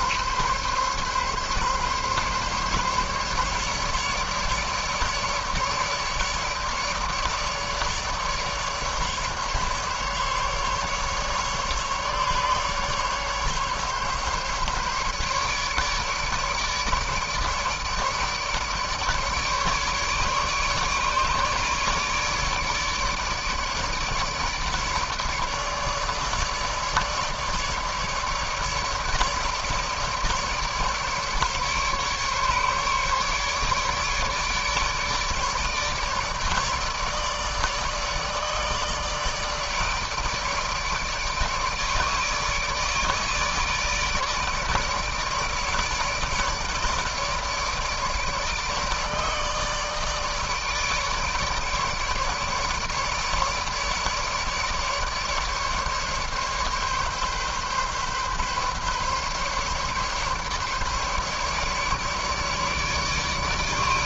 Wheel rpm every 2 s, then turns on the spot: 140, 140, 150, 150, 150, 140, 150, 140, 150, 150, 150, 150, 150, 150, 150, 150, 150, 150, 150, 150, 150, 150, 150, 150, 150, 150, 150, 150, 140, 140, 140, 150.
none